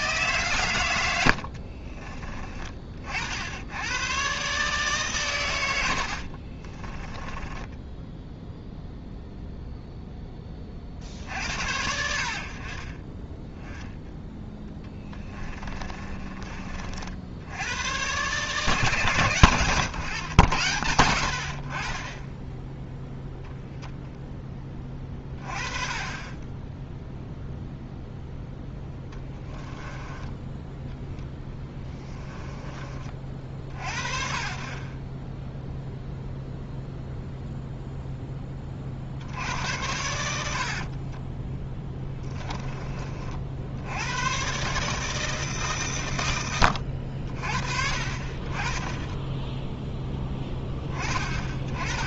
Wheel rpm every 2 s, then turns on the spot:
120, 50, 140, 30, 0, 50, 30, 10, 40, 150, 90, 0, 20, 10, 10, 10, 40, 30, 0, 50, 40, 30, 150, 80, 20, 20.
6-8 14-16 28-32 40-42